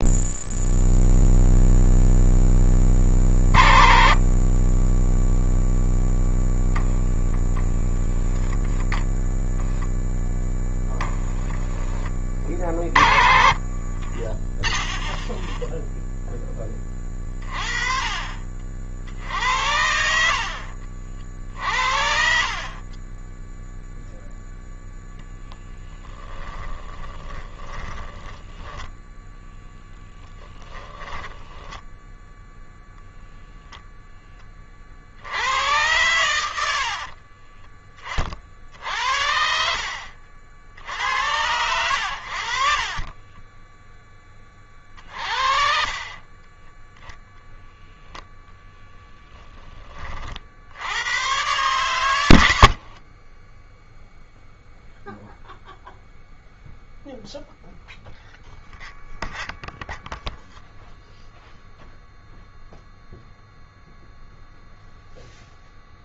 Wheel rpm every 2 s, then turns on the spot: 0, 20, 10, 0, 10, 10, 40, 0, 20, 60, 60, 30, 0, 10, 10, 30, 0, 50, 60, 60, 80, 40, 40, 10, 0, 90, 50, 0, 0, 0, 0, 0, 0.
26-32 36-38 42-44 52-54